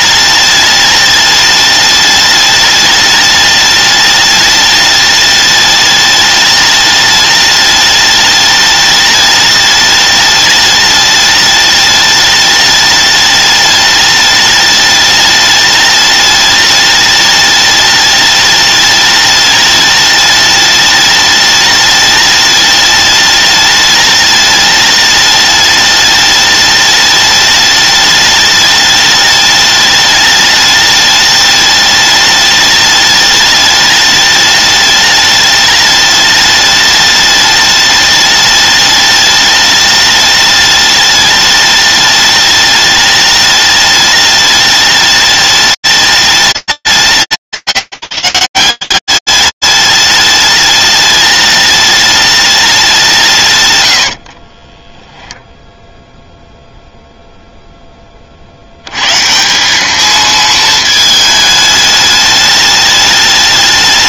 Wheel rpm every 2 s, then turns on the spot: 210, 210, 210, 210, 210, 210, 210, 210, 210, 210, 210, 210, 210, 210, 210, 210, 210, 210, 210, 210, 210, 210, 210, 190, 180, 210, 210, 30, 0, 120, 220, 210.
54-56